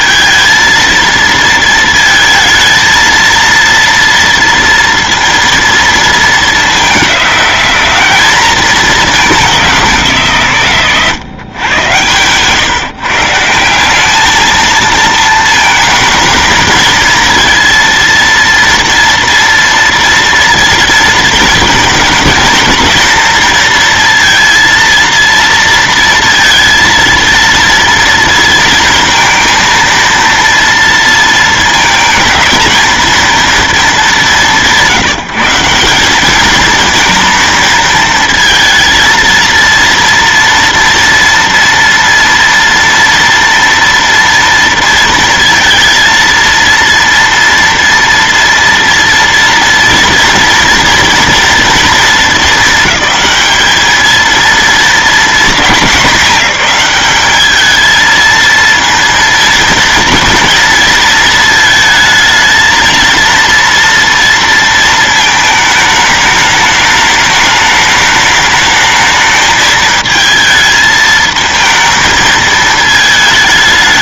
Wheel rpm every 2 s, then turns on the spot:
230, 230, 230, 210, 210, 140, 140, 220, 230, 230, 230, 230, 230, 230, 230, 230, 230, 170, 220, 230, 230, 230, 230, 230, 230, 230, 220, 220, 210, 230, 230, 220, 230, 210, 210, 220, 220.
10-12